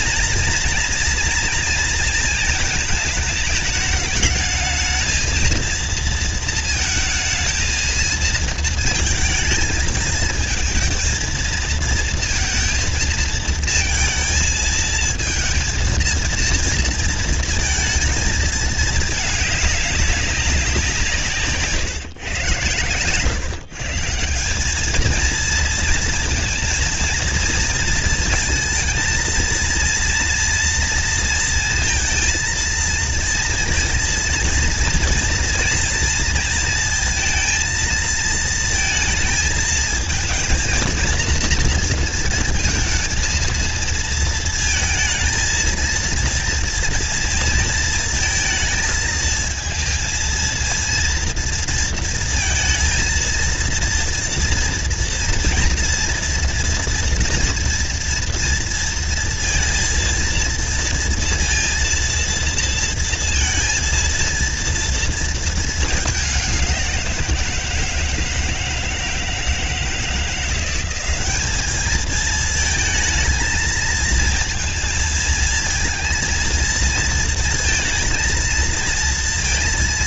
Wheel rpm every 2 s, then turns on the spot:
230, 230, 220, 220, 220, 220, 230, 220, 230, 220, 190, 110, 170, 230, 230, 230, 230, 230, 230, 230, 230, 230, 230, 230, 230, 230, 230, 230, 230, 230, 230, 230, 230, 210, 160, 170, 220, 230, 230, 220.
none